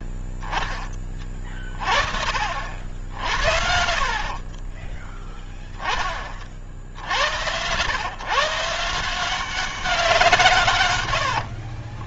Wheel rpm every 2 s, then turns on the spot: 10, 50, 40, 40, 140, 150.
4-6